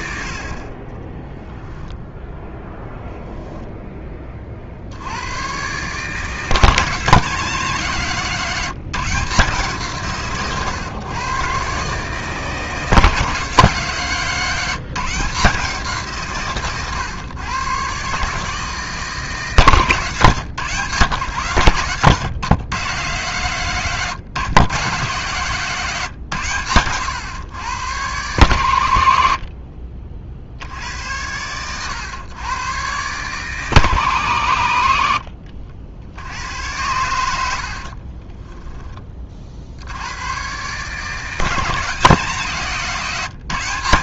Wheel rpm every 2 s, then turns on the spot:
40, 10, 40, 170, 170, 130, 160, 170, 130, 150, 130, 120, 140, 130, 110, 70, 120, 110, 90, 10, 130, 160.
none